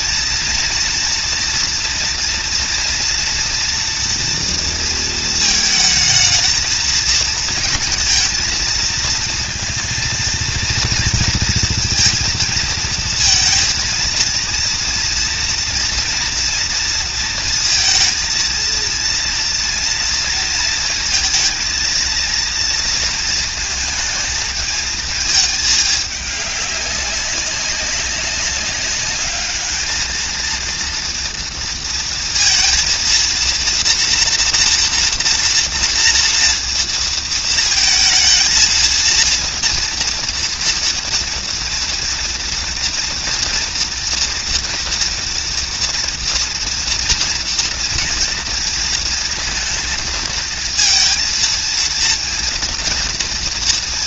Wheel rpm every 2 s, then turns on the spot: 230, 240, 230, 220, 230, 230, 230, 230, 230, 230, 230, 230, 220, 200, 200, 230, 230, 240, 230, 230, 230, 230, 230, 230, 230, 230, 240.
none